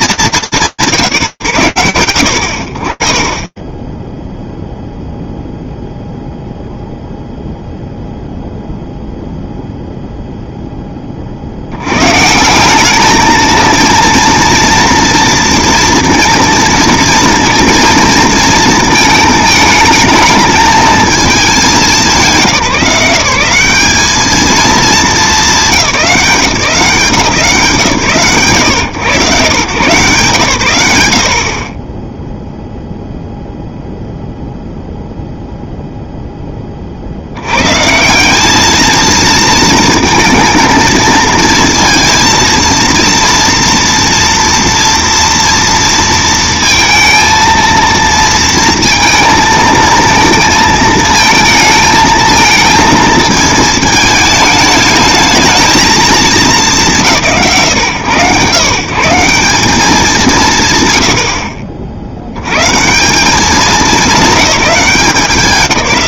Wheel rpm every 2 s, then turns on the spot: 70, 0, 0, 0, 0, 90, 220, 230, 230, 220, 190, 200, 190, 140, 130, 20, 0, 0, 70, 220, 230, 230, 230, 230, 220, 220, 220, 220, 140, 180, 70, 180, 190.
none